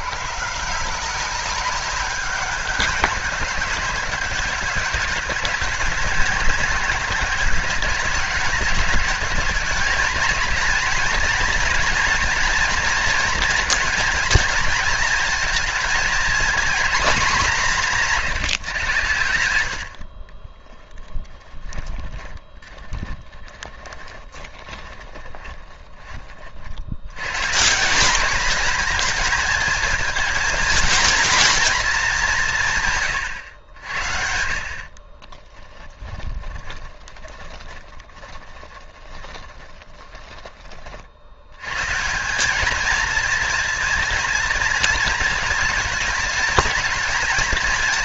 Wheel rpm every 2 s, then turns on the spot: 160, 200, 200, 190, 190, 220, 230, 230, 240, 140, 20, 20, 20, 60, 220, 230, 160, 50, 20, 20, 30, 210, 230, 230.
20-26 34-40